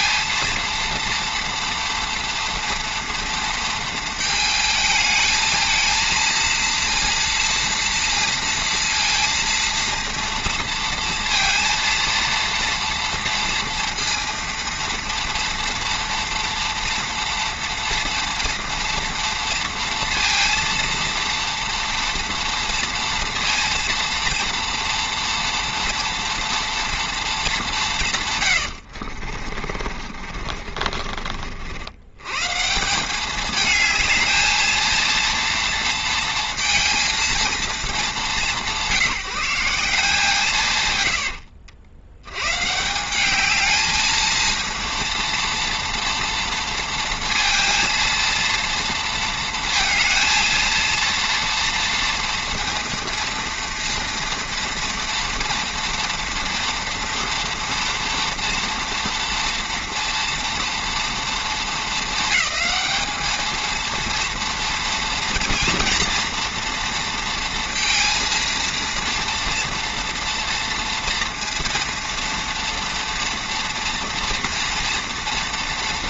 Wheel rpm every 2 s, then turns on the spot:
230, 230, 220, 230, 230, 230, 230, 230, 230, 230, 230, 240, 240, 230, 100, 40, 160, 230, 230, 160, 140, 140, 230, 230, 230, 230, 230, 230, 230, 230, 230, 220, 230, 230, 230, 230, 230, 240.
28-32